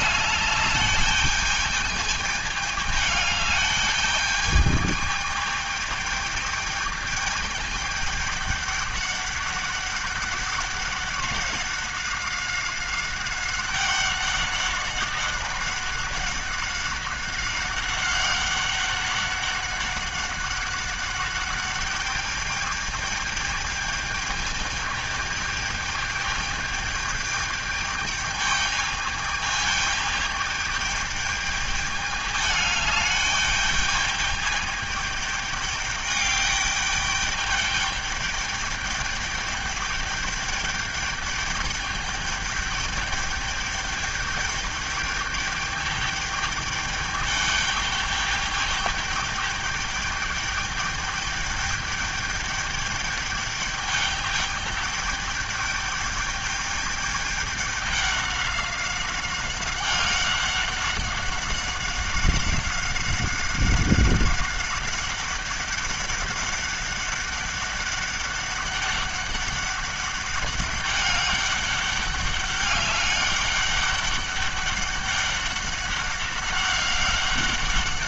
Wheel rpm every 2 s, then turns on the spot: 210, 210, 210, 210, 210, 200, 190, 190, 200, 200, 190, 210, 210, 210, 210, 210, 210, 210, 210, 210, 210, 210, 210, 210, 210, 210, 210, 210, 210, 200, 190, 190, 190, 200, 200, 200, 200, 200, 200.
none